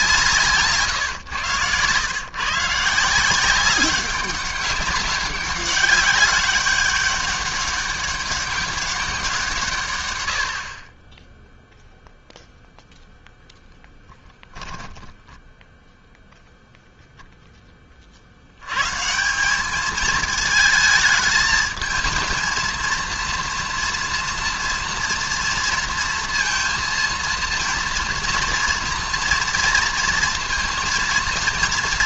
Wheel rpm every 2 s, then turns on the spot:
140, 150, 190, 200, 200, 40, 0, 10, 0, 120, 220, 230, 240, 230, 230, 230.
14-16